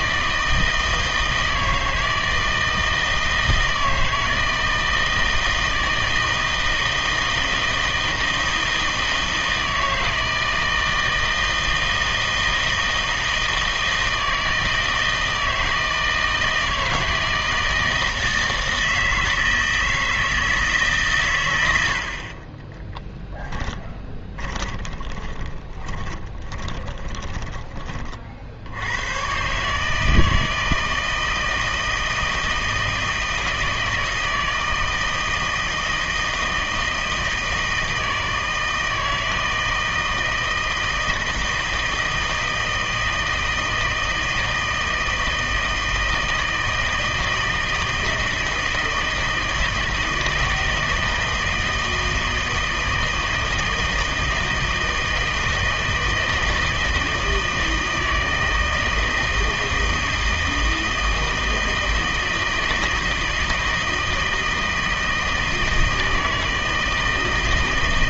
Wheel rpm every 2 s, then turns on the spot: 160, 160, 160, 160, 160, 160, 160, 160, 160, 160, 150, 20, 20, 20, 70, 160, 160, 160, 160, 160, 160, 160, 160, 160, 160, 160, 160, 160, 160, 160, 160, 160, 160, 160.
22-28